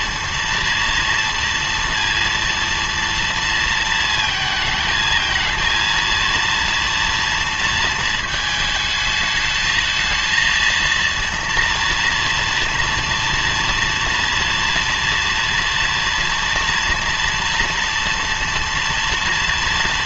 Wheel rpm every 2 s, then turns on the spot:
230, 230, 220, 230, 220, 230, 230, 230, 230, 230.
none